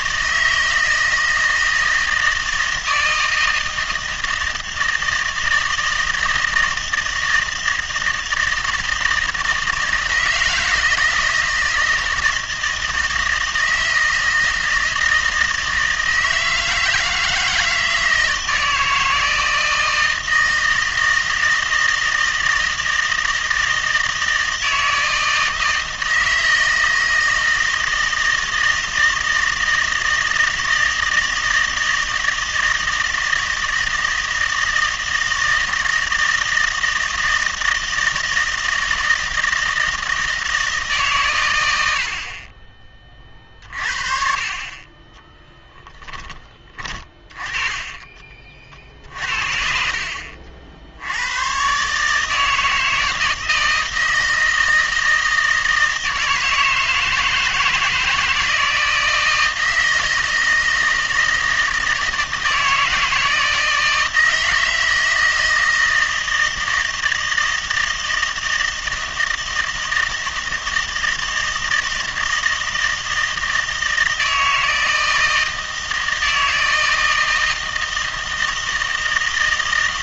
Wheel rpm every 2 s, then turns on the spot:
160, 160, 160, 160, 160, 160, 160, 160, 160, 160, 160, 160, 160, 160, 160, 160, 160, 160, 160, 160, 160, 40, 30, 20, 40, 70, 160, 160, 160, 160, 160, 160, 160, 160, 160, 160, 160, 160, 160, 160.
46-48